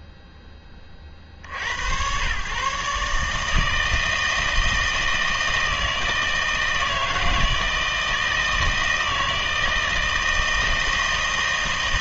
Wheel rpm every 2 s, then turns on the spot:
0, 120, 160, 160, 160, 160.
none